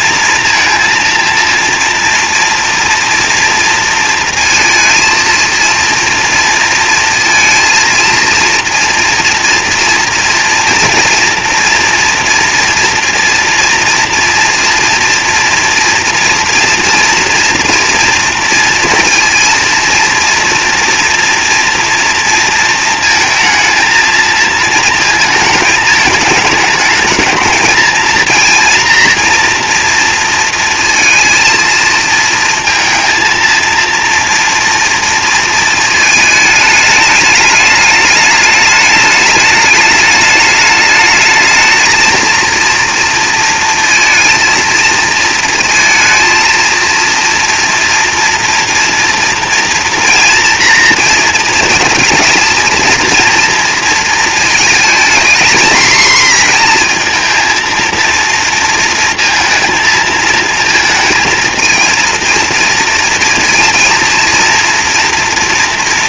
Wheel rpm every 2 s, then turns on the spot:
230, 230, 220, 230, 230, 230, 230, 240, 230, 230, 230, 230, 230, 220, 230, 230, 220, 230, 210, 210, 210, 230, 230, 230, 230, 230, 230, 220, 230, 230, 230, 230, 230.
none